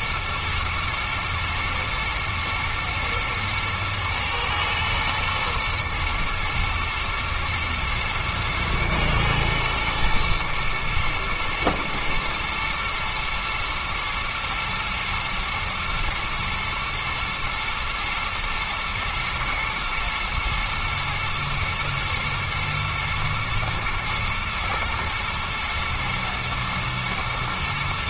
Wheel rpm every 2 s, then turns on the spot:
120, 110, 110, 110, 110, 120, 120, 110, 110, 120, 120, 110, 110, 110.
none